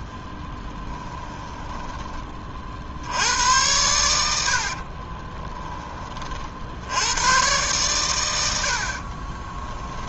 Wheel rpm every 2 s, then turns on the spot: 10, 40, 70, 50, 90.
0-2